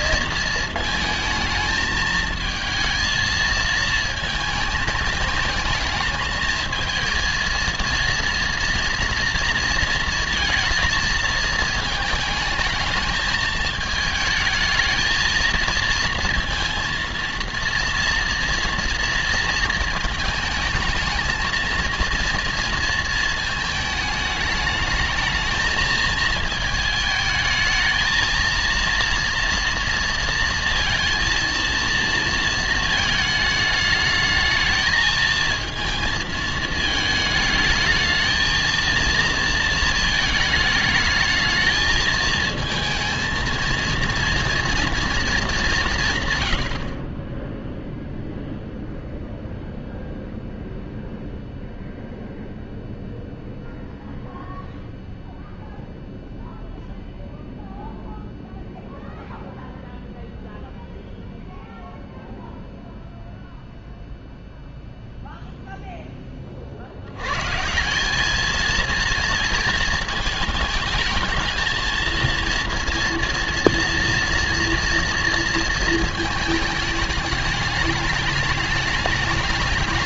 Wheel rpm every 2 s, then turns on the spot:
230, 220, 220, 220, 230, 230, 220, 220, 230, 240, 220, 230, 210, 220, 230, 230, 230, 220, 220, 220, 220, 220, 240, 100, 0, 0, 0, 0, 0, 0, 0, 0, 0, 50, 220, 220, 230, 230, 220, 210.
none